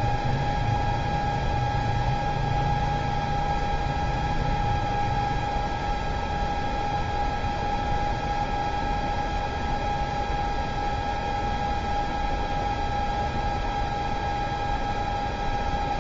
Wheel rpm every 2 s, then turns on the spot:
0, 0, 0, 0, 0, 0, 0, 0.
none